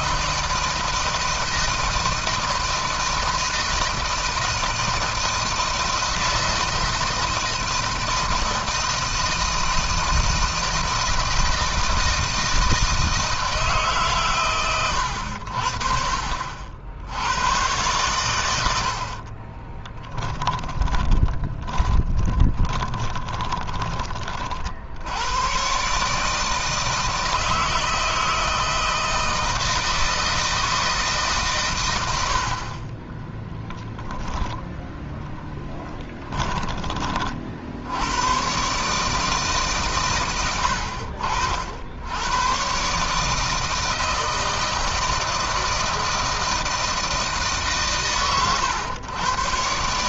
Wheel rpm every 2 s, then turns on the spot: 160, 160, 160, 160, 160, 160, 160, 120, 60, 80, 20, 20, 50, 160, 160, 160, 40, 10, 20, 130, 80, 120, 160, 160, 110.
20-24